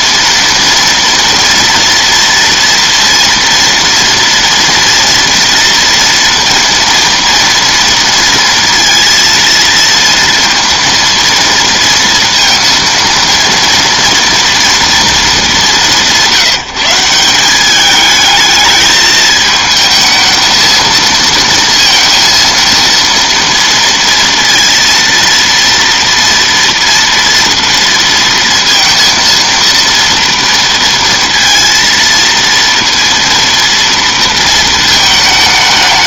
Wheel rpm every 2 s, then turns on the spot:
230, 230, 240, 230, 230, 230, 230, 230, 170, 210, 230, 230, 230, 230, 230, 230, 230, 220.
none